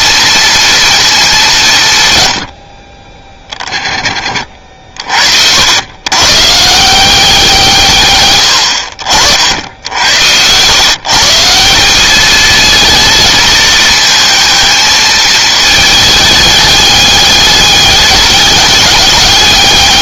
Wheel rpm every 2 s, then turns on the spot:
230, 50, 50, 160, 80, 130, 220, 220, 210, 200.
none